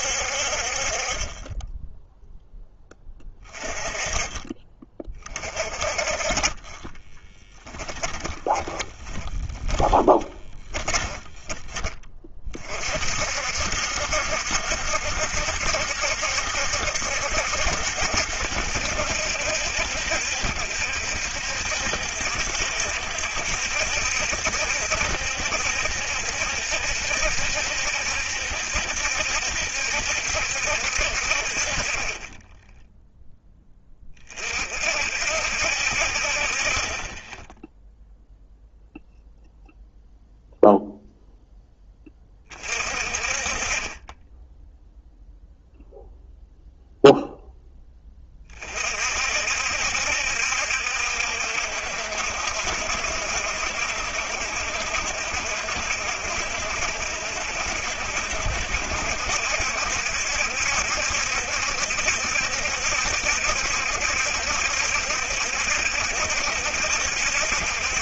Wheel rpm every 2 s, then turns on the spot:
50, 10, 20, 30, 20, 20, 40, 70, 70, 70, 60, 60, 70, 70, 70, 60, 10, 40, 40, 0, 0, 30, 10, 0, 40, 70, 70, 70, 70, 70, 70, 70, 70, 70.
6-12